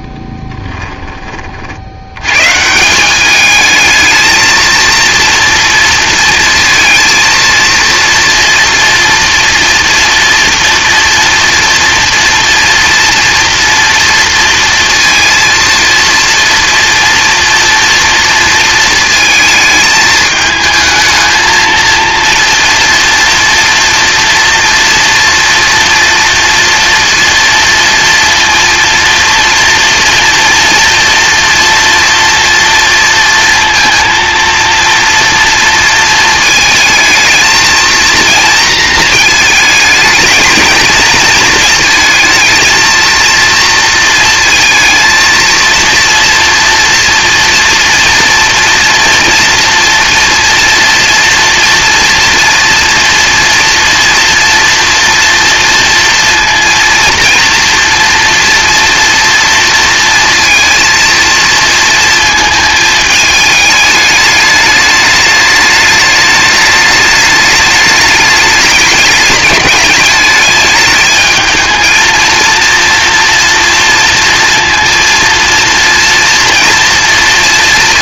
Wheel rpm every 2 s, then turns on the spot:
10, 150, 230, 230, 230, 230, 230, 230, 230, 230, 220, 230, 230, 230, 230, 240, 230, 230, 220, 230, 220, 220, 230, 230, 230, 230, 230, 240, 230, 230, 230, 220, 210, 210, 210, 210, 230, 230, 230.
0-2